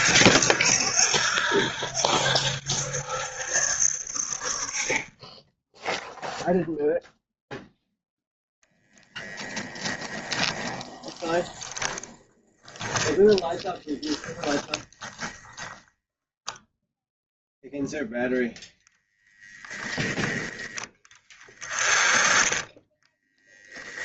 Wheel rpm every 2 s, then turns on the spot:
70, 70, 30, 0, 0, 20, 10, 10, 0, 0, 10, 10.
12-16 22-24